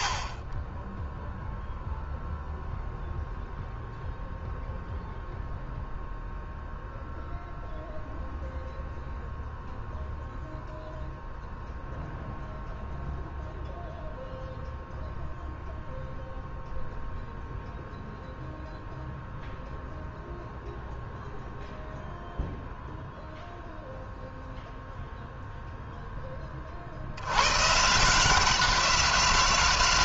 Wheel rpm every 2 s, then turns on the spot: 10, 0, 0, 0, 0, 0, 0, 0, 0, 0, 0, 0, 0, 60, 180.
none